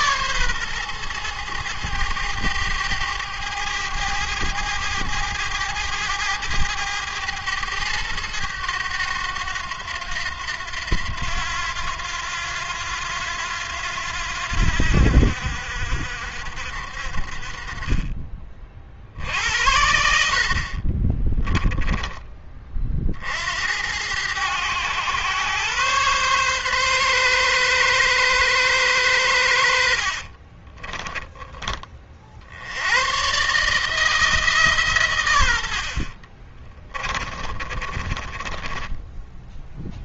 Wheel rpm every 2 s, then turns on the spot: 130, 110, 100, 100, 100, 90, 90, 80, 60, 40, 40, 30, 100, 130, 120, 40, 80, 150, 30, 20.
20-22 30-32 36-40